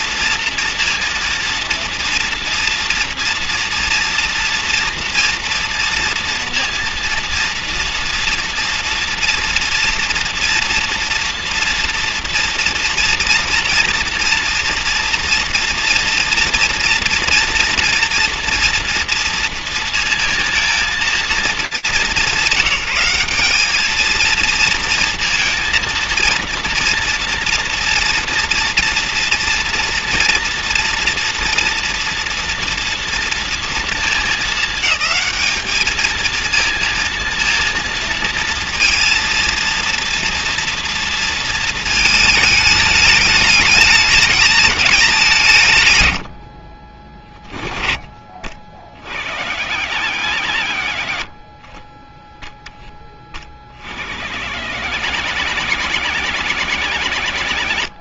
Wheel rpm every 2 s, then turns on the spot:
230, 240, 240, 230, 240, 230, 230, 240, 230, 230, 230, 190, 230, 230, 240, 240, 230, 210, 230, 230, 240, 210, 220, 50, 50, 60, 10, 110, 90.
46-48